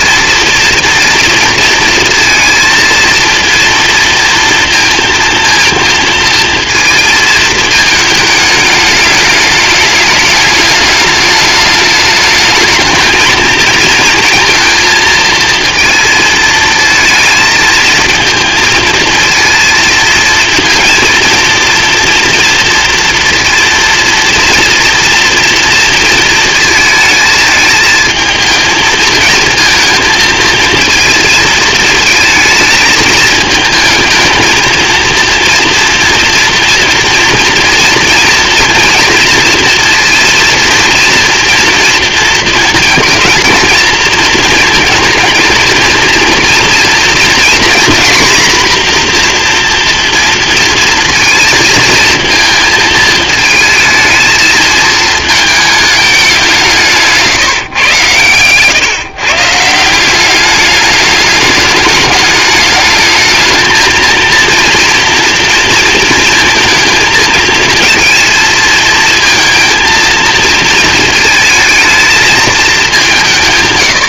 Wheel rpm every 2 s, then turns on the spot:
230, 230, 230, 230, 210, 210, 220, 230, 220, 230, 230, 230, 230, 220, 220, 230, 220, 230, 230, 230, 230, 220, 230, 230, 240, 230, 220, 220, 170, 130, 210, 210, 230, 230, 220, 230, 200.
none